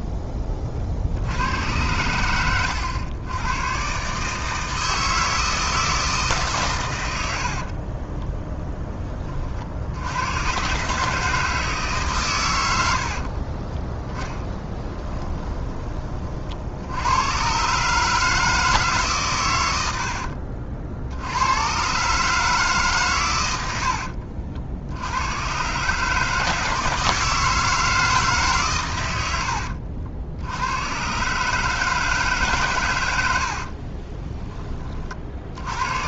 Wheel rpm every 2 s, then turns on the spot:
30, 100, 160, 110, 10, 140, 70, 10, 70, 150, 60, 140, 70, 160, 110, 110, 120, 30.
12-16